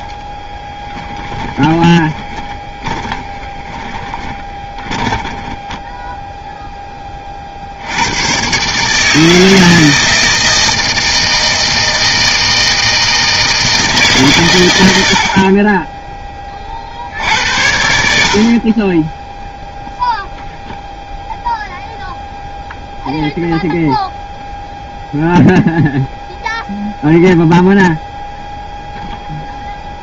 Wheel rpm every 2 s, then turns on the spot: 10, 20, 10, 0, 140, 160, 160, 100, 40, 30, 0, 0, 0, 0, 0.
0-6